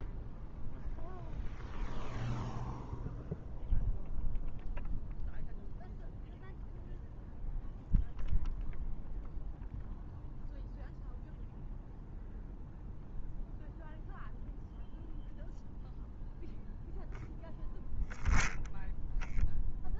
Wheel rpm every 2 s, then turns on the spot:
0, 0, 0, 0, 0, 0, 0, 0, 0, 10.
none